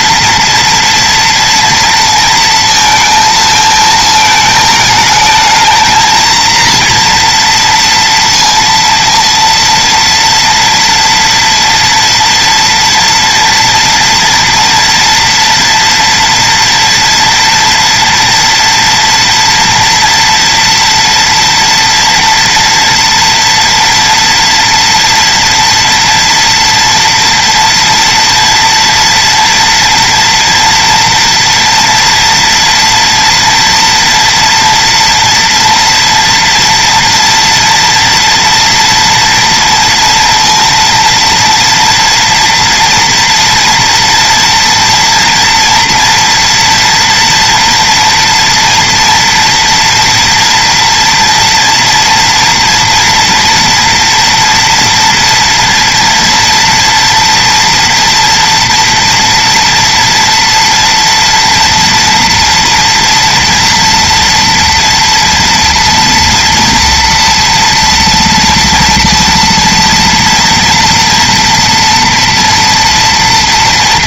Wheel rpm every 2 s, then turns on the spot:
240, 230, 220, 230, 230, 230, 230, 230, 230, 230, 230, 230, 230, 230, 230, 230, 230, 240, 230, 230, 230, 230, 230, 230, 240, 230, 240, 230, 230, 230, 230, 230, 230, 230, 230, 230, 230.
none